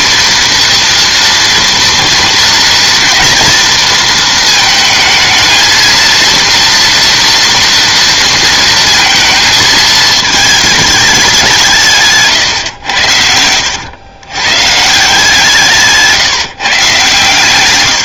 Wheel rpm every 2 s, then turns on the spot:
230, 230, 220, 230, 230, 220, 120, 140, 150.
12-14